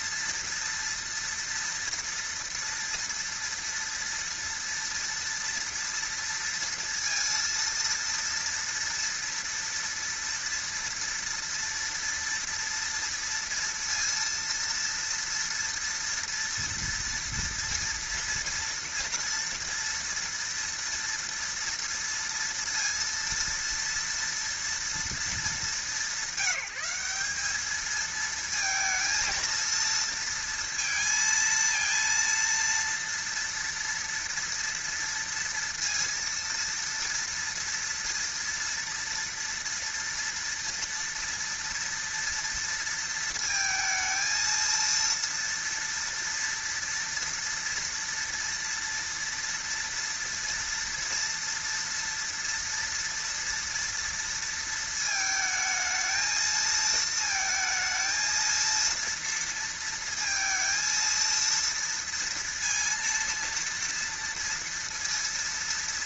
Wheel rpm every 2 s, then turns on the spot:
240, 230, 230, 230, 230, 230, 230, 230, 240, 230, 230, 230, 220, 180, 230, 230, 230, 230, 230, 230, 230, 230, 230, 230, 230, 230, 230, 220, 220, 230, 230, 230, 230.
none